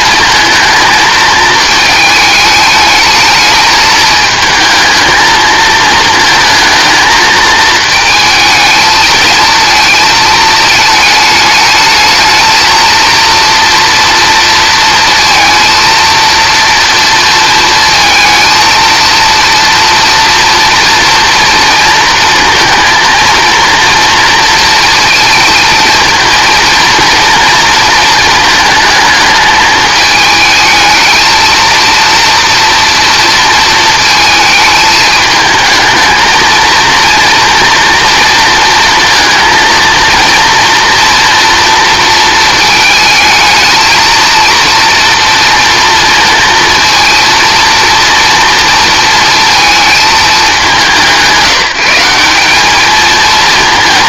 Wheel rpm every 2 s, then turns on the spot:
220, 220, 220, 220, 220, 220, 230, 230, 230, 230, 240, 230, 230, 230, 220, 220, 230, 220, 230, 230, 230, 220, 230, 230, 230, 180, 220.
none